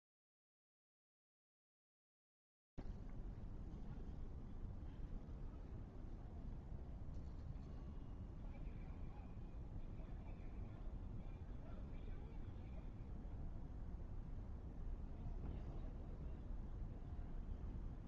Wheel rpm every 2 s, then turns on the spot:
0, 0, 0, 0, 0, 0, 0, 0, 0.
none